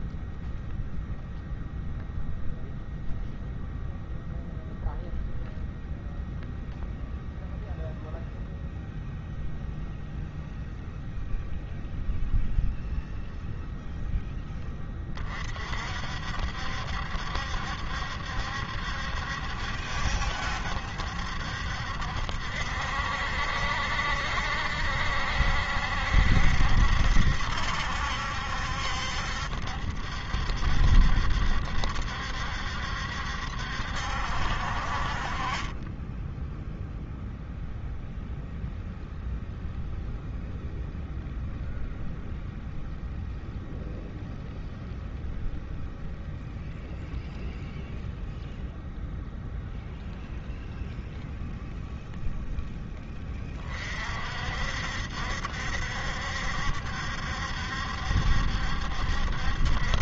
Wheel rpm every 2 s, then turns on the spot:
0, 0, 0, 0, 0, 0, 0, 20, 70, 70, 70, 70, 70, 70, 70, 70, 70, 40, 0, 0, 0, 0, 0, 0, 0, 0, 10, 60, 70, 70.
none